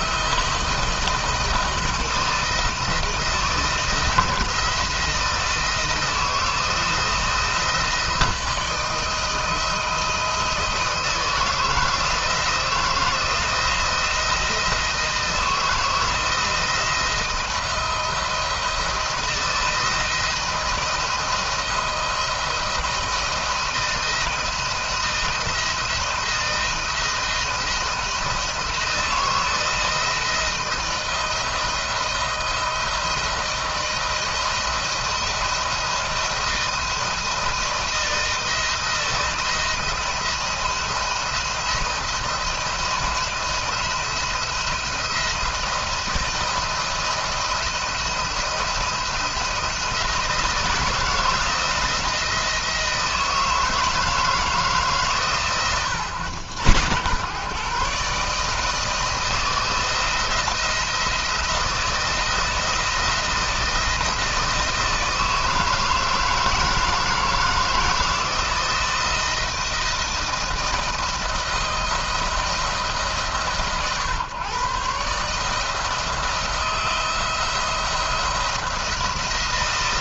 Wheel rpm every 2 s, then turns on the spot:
160, 160, 170, 170, 160, 160, 170, 170, 160, 170, 160, 170, 160, 170, 170, 170, 170, 160, 160, 160, 170, 170, 170, 170, 170, 160, 160, 140, 100, 160, 170, 160, 160, 160, 170, 160, 150, 140, 170, 170.
none